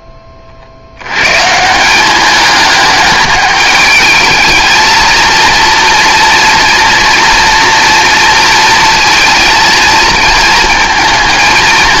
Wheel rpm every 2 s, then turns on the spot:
60, 210, 230, 230, 230, 220.
none